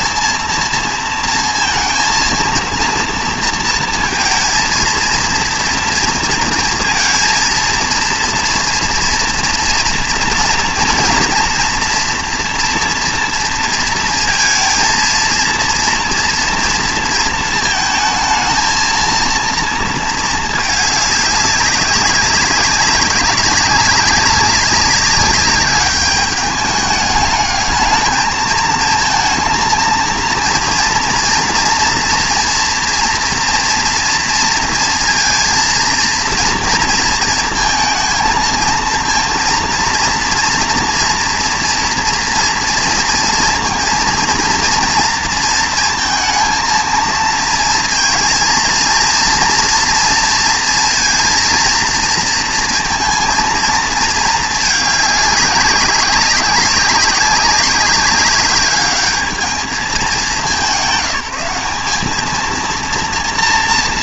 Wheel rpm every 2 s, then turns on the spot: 230, 230, 230, 230, 230, 230, 230, 230, 240, 220, 210, 200, 200, 210, 220, 230, 230, 230, 230, 220, 240, 230, 230, 230, 230, 230, 230, 210, 190, 200, 190, 230.
none